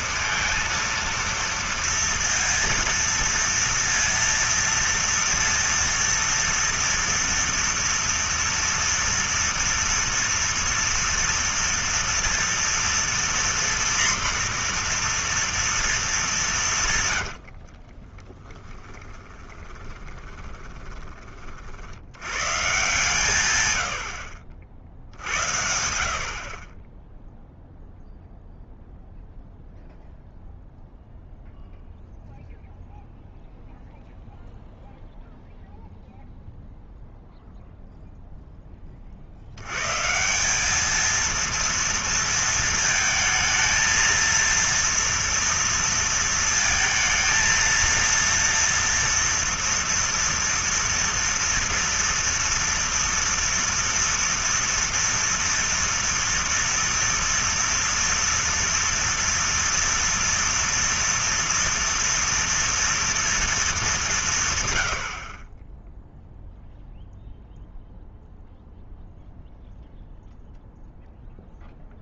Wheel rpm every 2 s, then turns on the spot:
230, 230, 230, 230, 230, 230, 230, 240, 170, 10, 20, 120, 50, 40, 0, 0, 0, 0, 0, 10, 200, 230, 230, 230, 230, 230, 230, 230, 230, 230, 230, 230, 130, 0, 0, 0.
20-22